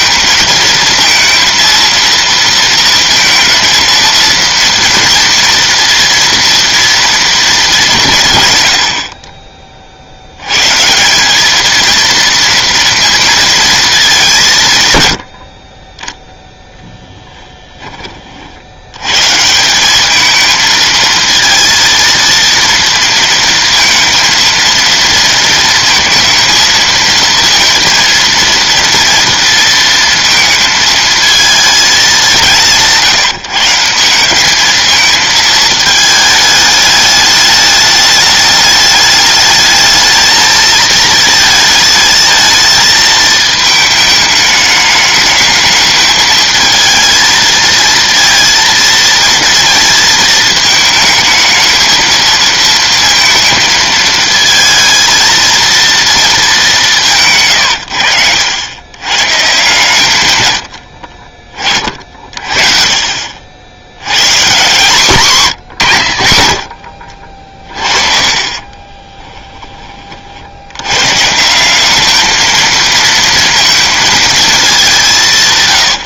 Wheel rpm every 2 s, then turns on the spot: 220, 230, 230, 230, 130, 110, 230, 180, 0, 50, 220, 230, 230, 230, 230, 230, 170, 200, 210, 210, 220, 220, 210, 220, 230, 220, 230, 230, 220, 90, 110, 50, 140, 70, 30, 70, 220, 220.
68-70